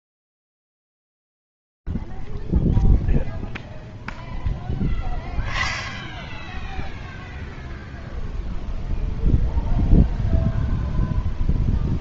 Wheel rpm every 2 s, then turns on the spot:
0, 0, 0, 0, 0, 0.
none